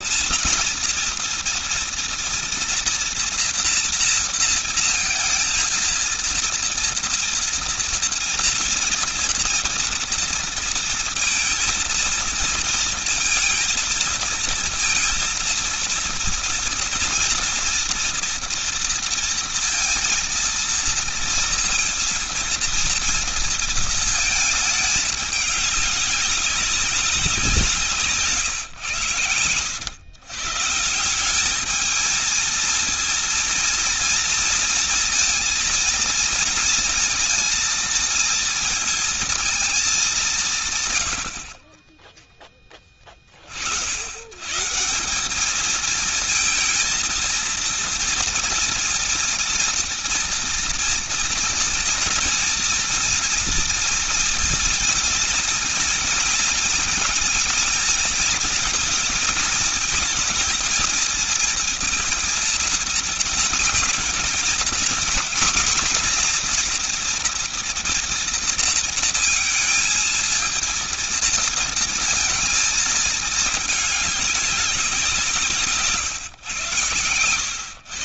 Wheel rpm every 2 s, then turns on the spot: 230, 240, 230, 230, 230, 230, 230, 230, 230, 230, 230, 230, 220, 190, 140, 140, 220, 230, 230, 230, 160, 10, 140, 230, 230, 230, 230, 230, 220, 220, 230, 230, 230, 240, 230, 220, 220, 190, 130.
none